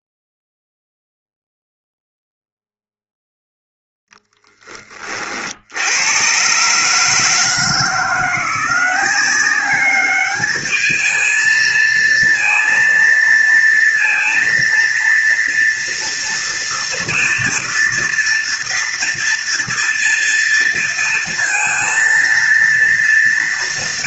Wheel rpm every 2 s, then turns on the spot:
0, 0, 10, 130, 170, 210, 230, 230, 230, 230, 230, 230.
none